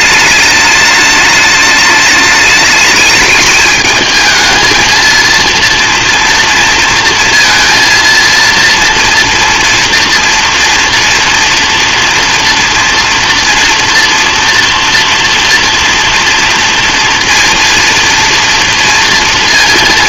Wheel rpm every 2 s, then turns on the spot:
210, 210, 230, 230, 230, 230, 230, 230, 230, 230.
none